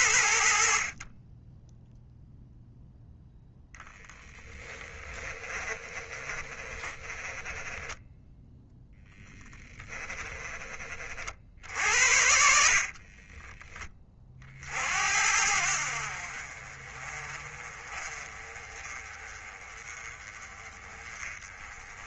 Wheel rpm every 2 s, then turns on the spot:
50, 0, 10, 20, 0, 30, 40, 70, 30, 30, 30.
4-6 12-14